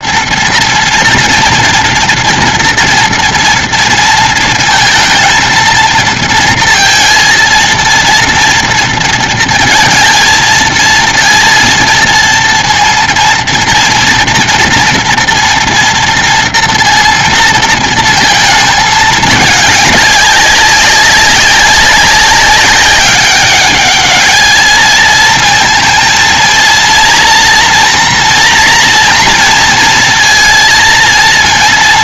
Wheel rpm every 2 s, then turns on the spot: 230, 240, 230, 230, 230, 230, 230, 230, 230, 230, 200, 190, 210, 230, 240, 230.
none